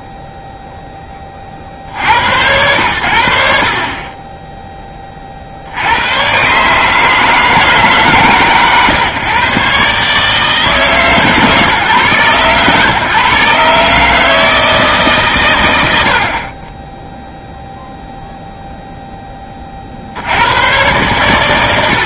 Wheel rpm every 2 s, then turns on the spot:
0, 110, 20, 140, 140, 160, 130, 160, 10, 0, 120.
none